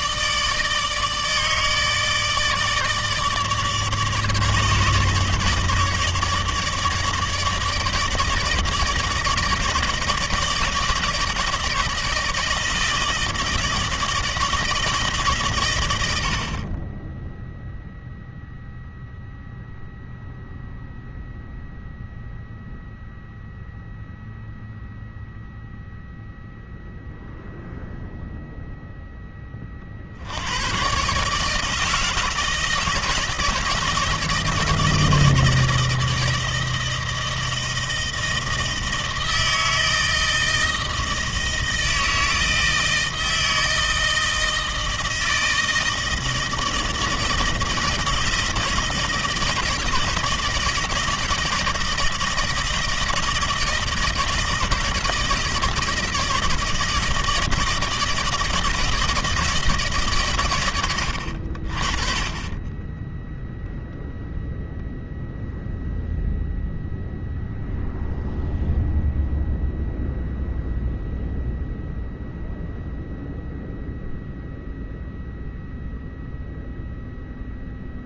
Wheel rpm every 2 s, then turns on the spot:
150, 150, 150, 150, 150, 160, 160, 140, 10, 0, 0, 0, 0, 0, 0, 120, 160, 160, 160, 160, 160, 160, 160, 160, 160, 160, 160, 160, 160, 170, 110, 20, 0, 0, 0, 0, 0, 0, 0.
none